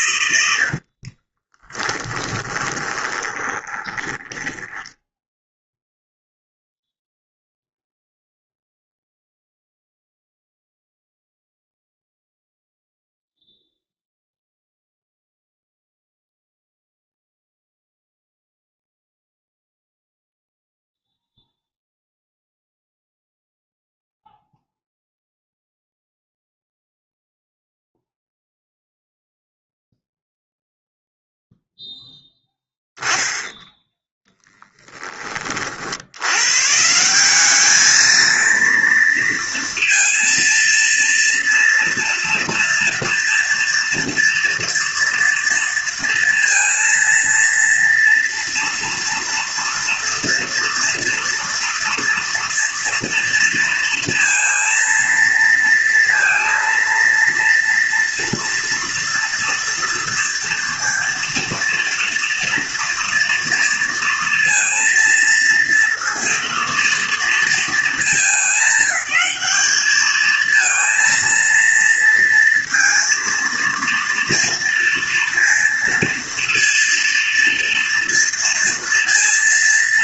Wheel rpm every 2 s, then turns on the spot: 50, 30, 10, 0, 0, 0, 0, 0, 0, 0, 0, 0, 0, 0, 0, 0, 10, 10, 160, 230, 230, 230, 230, 230, 230, 230, 230, 230, 230, 240, 230, 230, 230, 230, 200, 230, 230, 230, 230, 230.
0-6